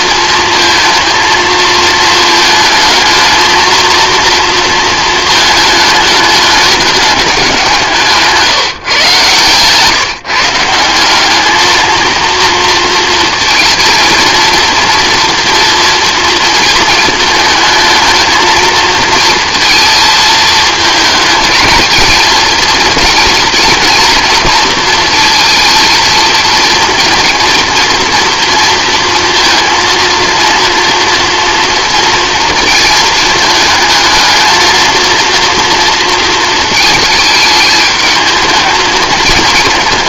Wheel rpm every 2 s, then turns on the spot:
230, 220, 230, 210, 150, 160, 230, 230, 220, 220, 220, 230, 230, 230, 230, 230, 230, 220, 220, 220.
none